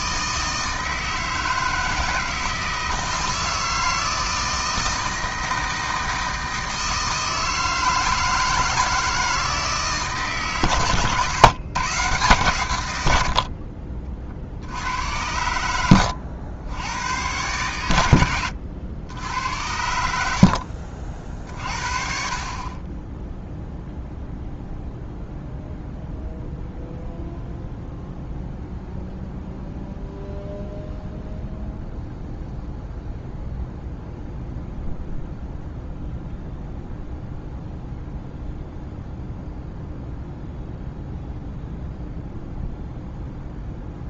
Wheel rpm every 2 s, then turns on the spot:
160, 160, 160, 160, 160, 130, 120, 60, 90, 80, 60, 30, 0, 0, 0, 0, 0, 0, 0, 0, 0, 0.
none